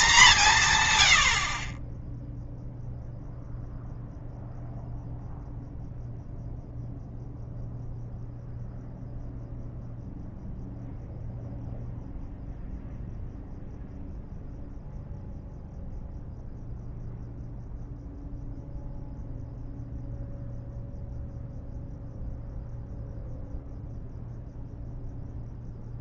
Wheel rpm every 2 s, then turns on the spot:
120, 0, 0, 0, 0, 0, 0, 0, 0, 0, 0, 0, 0.
none